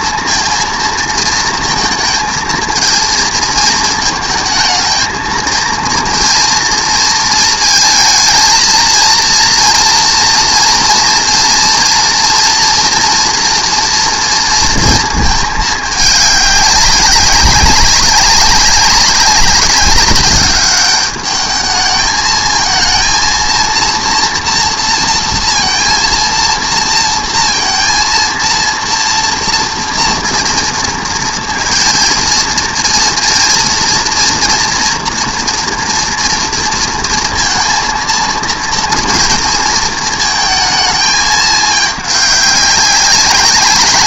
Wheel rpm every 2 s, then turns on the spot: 230, 220, 220, 230, 220, 230, 240, 230, 200, 200, 200, 220, 230, 230, 230, 230, 230, 240, 230, 230, 220, 200.
none